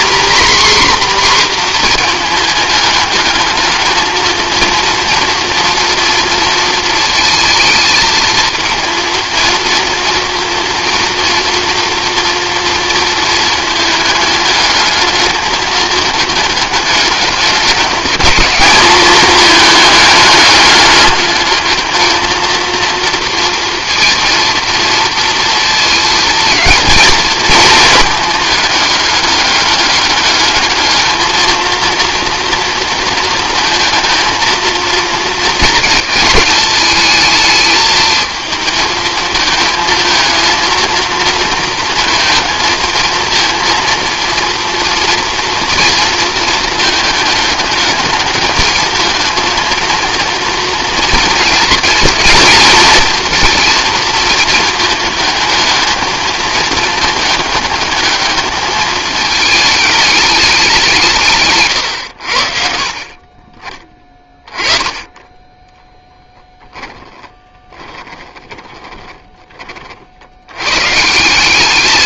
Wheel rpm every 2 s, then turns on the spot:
260, 220, 230, 230, 220, 230, 230, 210, 210, 210, 210, 230, 230, 220, 210, 210, 230, 230, 210, 220, 230, 220, 230, 220, 220, 230, 230, 220, 220, 220, 190, 60, 20, 10, 20, 120.
66-70